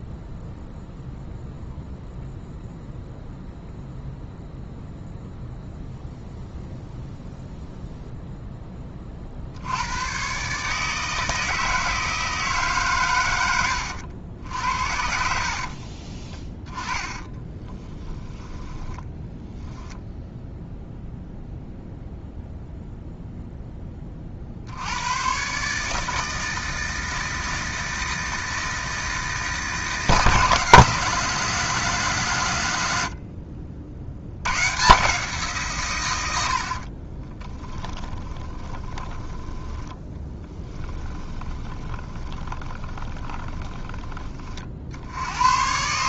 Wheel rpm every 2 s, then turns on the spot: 0, 0, 0, 0, 10, 140, 150, 70, 20, 10, 0, 0, 70, 160, 160, 160, 120, 120, 60, 20, 20, 20, 60.
16-20 38-44